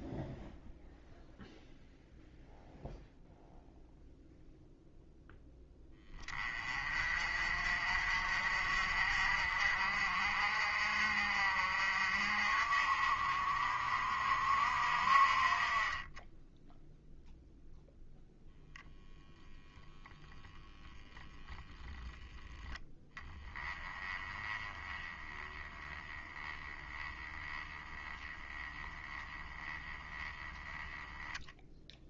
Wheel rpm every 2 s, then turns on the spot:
0, 0, 0, 30, 50, 50, 50, 50, 0, 0, 0, 10, 20, 10, 10, 10.
none